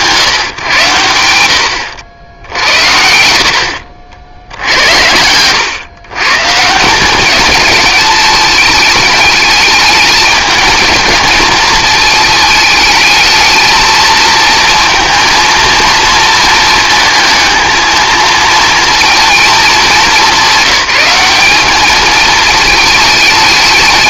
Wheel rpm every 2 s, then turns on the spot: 110, 80, 80, 160, 210, 220, 220, 230, 220, 230, 200, 220.
none